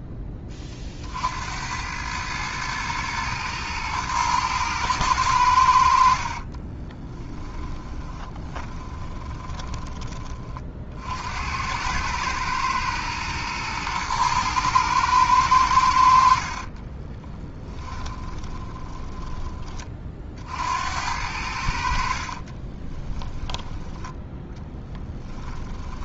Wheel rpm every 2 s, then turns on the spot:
20, 110, 110, 30, 20, 50, 110, 110, 40, 20, 70, 20, 10.
6-10 16-20 22-24